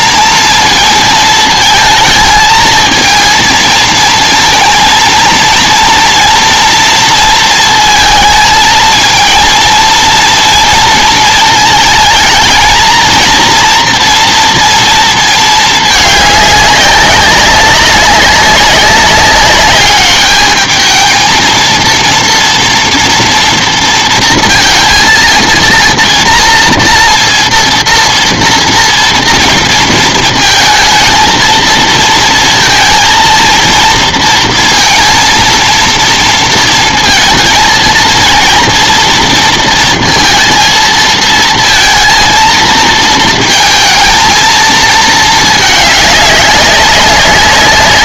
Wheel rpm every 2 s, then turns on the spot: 230, 220, 230, 230, 220, 230, 220, 230, 200, 190, 220, 230, 230, 240, 230, 230, 230, 230, 230, 230, 230, 230, 220, 200.
none